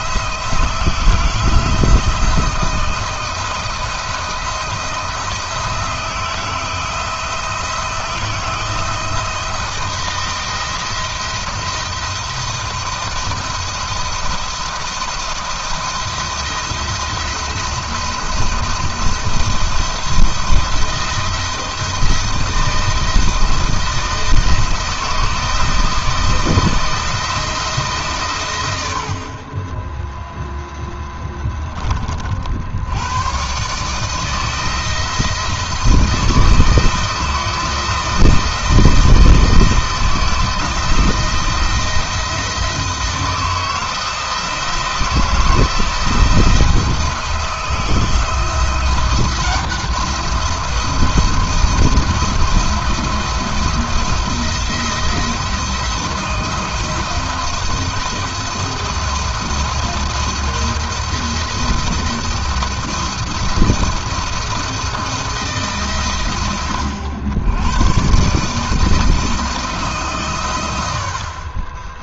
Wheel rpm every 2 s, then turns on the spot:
170, 170, 170, 160, 170, 170, 170, 170, 170, 170, 170, 160, 160, 160, 50, 10, 100, 160, 160, 170, 160, 170, 170, 170, 170, 170, 170, 170, 170, 160, 170, 170, 170, 90, 160, 70.
none